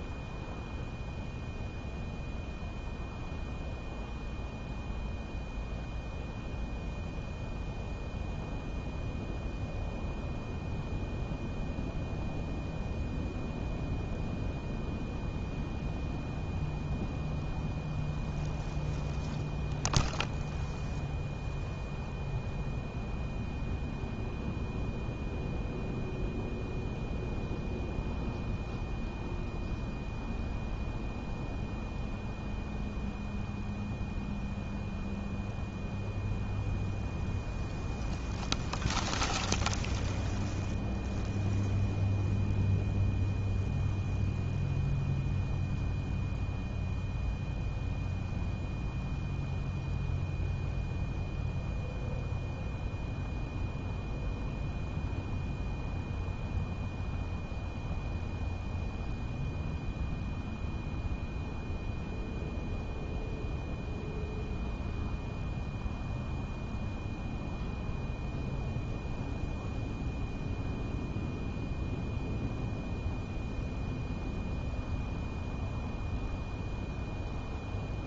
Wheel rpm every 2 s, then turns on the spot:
0, 0, 0, 0, 0, 0, 0, 0, 0, 0, 0, 0, 0, 0, 0, 0, 0, 0, 0, 0, 0, 0, 0, 0, 0, 0, 0, 0, 0, 0, 0, 0, 0, 0, 0, 0, 0, 0, 0.
none